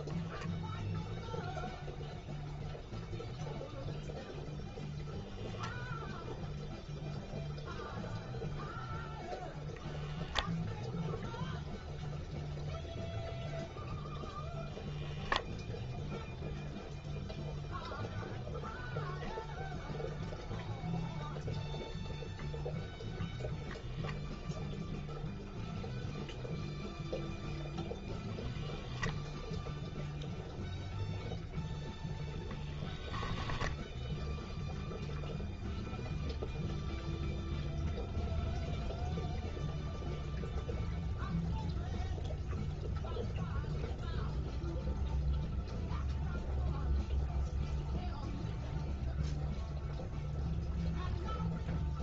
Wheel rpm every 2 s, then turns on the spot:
0, 0, 0, 0, 0, 0, 0, 0, 0, 0, 0, 0, 0, 0, 0, 0, 0, 0, 0, 0, 0, 0, 0, 0, 0, 0.
none